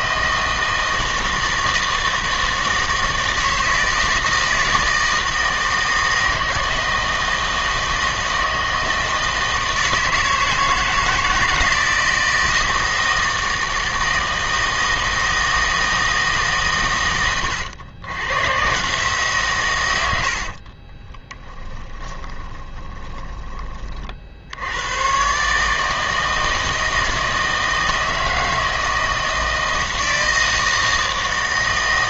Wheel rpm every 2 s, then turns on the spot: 160, 160, 160, 160, 160, 160, 160, 160, 140, 130, 50, 20, 90, 160, 160, 160.
20-24